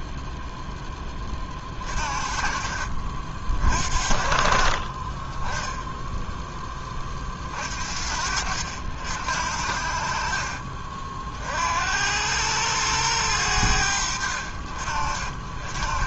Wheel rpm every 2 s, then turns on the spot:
0, 40, 50, 20, 70, 40, 100, 50.
none